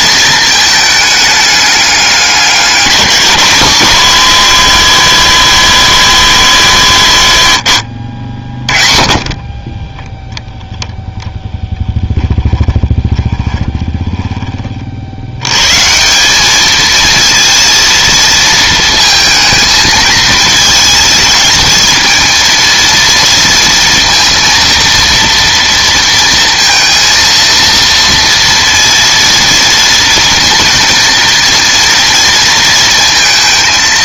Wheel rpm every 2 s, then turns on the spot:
220, 190, 220, 200, 40, 0, 20, 30, 210, 220, 220, 230, 230, 230, 230, 230, 230.
8-10 12-14